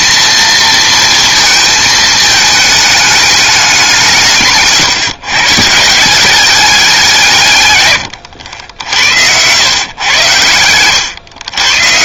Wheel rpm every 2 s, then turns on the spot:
230, 220, 150, 190, 80, 100.
8-10